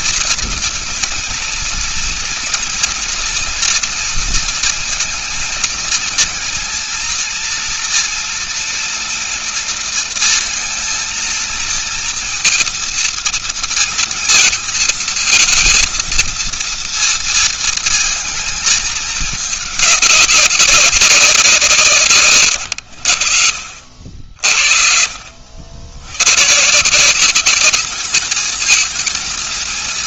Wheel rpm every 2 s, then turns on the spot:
230, 230, 230, 230, 230, 230, 230, 230, 230, 220, 190, 90, 50, 130, 220.
none